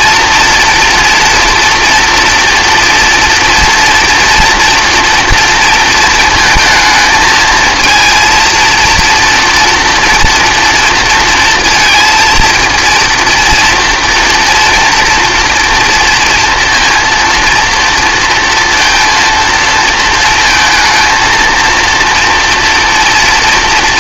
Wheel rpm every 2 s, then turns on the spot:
230, 240, 240, 220, 230, 230, 230, 230, 230, 230, 230, 240.
none